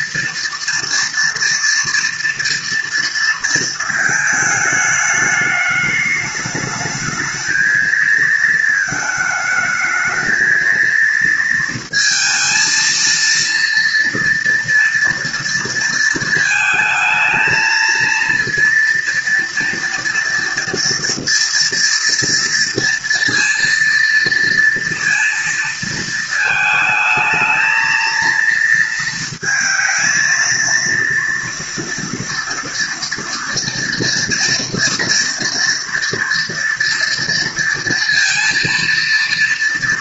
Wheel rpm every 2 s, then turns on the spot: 230, 230, 220, 210, 230, 230, 230, 230, 220, 230, 230, 230, 230, 220, 230, 230, 230, 230, 230, 230.
none